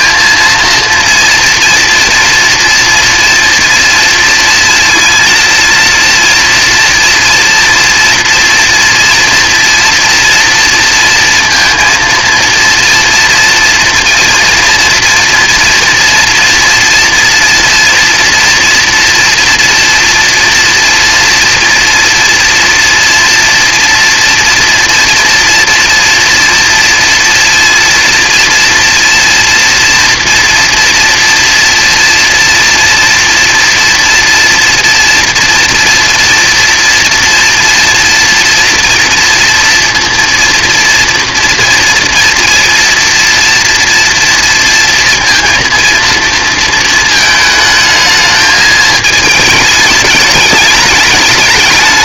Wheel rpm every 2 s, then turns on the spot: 230, 230, 230, 240, 230, 230, 230, 230, 230, 240, 240, 230, 230, 230, 230, 230, 230, 230, 230, 230, 230, 230, 230, 230, 220, 210.
none